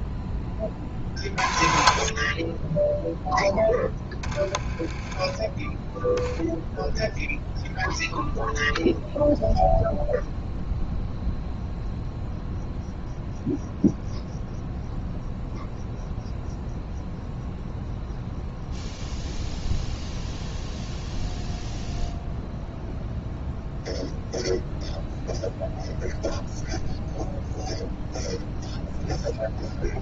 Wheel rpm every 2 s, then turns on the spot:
30, 20, 20, 10, 0, 0, 0, 0, 0, 0, 0, 0, 0, 0, 0.
none